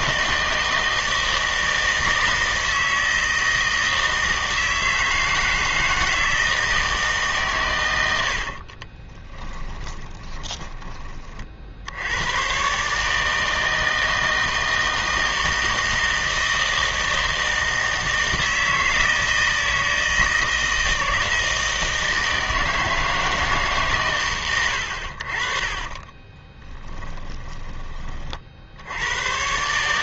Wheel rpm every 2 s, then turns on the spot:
160, 160, 160, 160, 40, 20, 130, 160, 160, 160, 160, 160, 90, 10, 70.
8-10 26-28